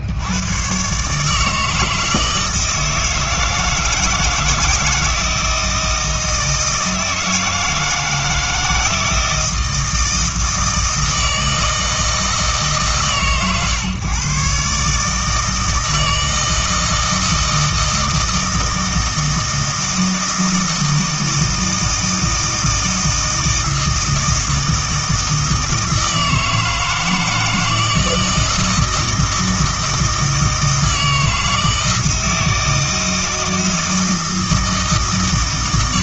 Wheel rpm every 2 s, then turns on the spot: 110, 160, 160, 160, 160, 160, 150, 140, 160, 160, 160, 160, 160, 160, 160, 160, 160, 160.
none